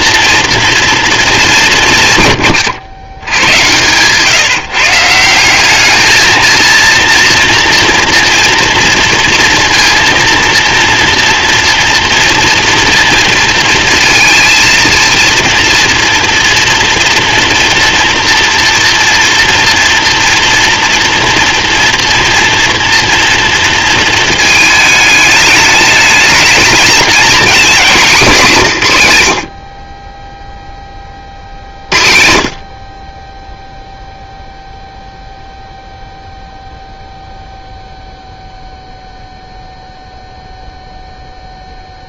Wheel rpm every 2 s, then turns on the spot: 230, 110, 160, 230, 230, 240, 230, 230, 230, 230, 230, 230, 210, 230, 130, 20, 40, 0, 0, 0, 0.
none